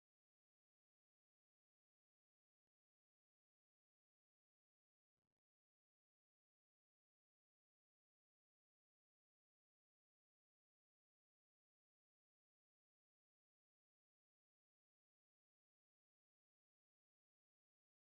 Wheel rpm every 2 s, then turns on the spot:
0, 0, 0, 0, 0, 0, 0, 0, 0.
none